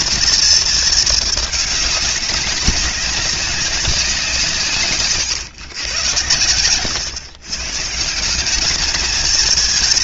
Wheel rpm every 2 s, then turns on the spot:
230, 210, 160, 100, 200.
none